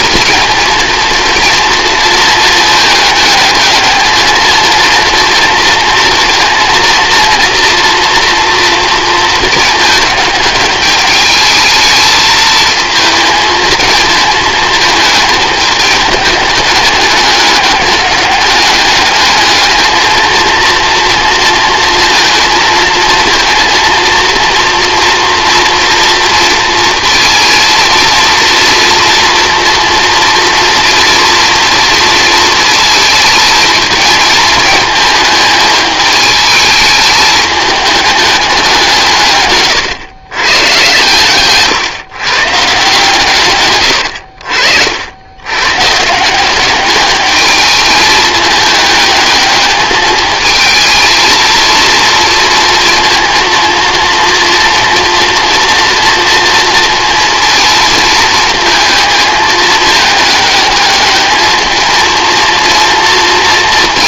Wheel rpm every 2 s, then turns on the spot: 230, 220, 230, 230, 230, 210, 220, 220, 200, 200, 230, 230, 230, 230, 230, 230, 230, 220, 220, 190, 120, 140, 70, 190, 210, 220, 230, 230, 230, 220, 210, 230.
none